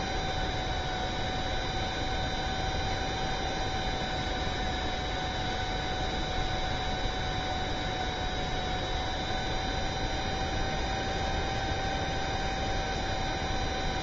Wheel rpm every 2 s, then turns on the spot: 0, 0, 0, 0, 0, 0, 0.
none